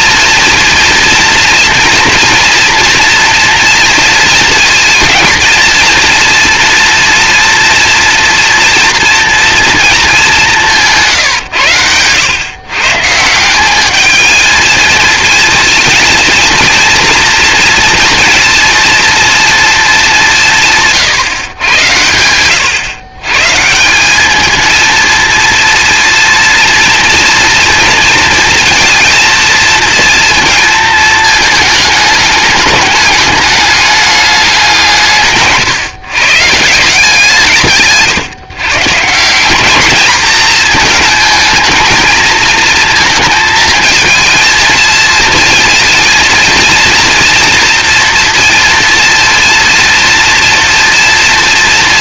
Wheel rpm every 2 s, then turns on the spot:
240, 230, 230, 230, 230, 170, 140, 220, 230, 230, 160, 120, 230, 230, 230, 220, 200, 180, 170, 140, 220, 230, 230, 230, 230, 230.
none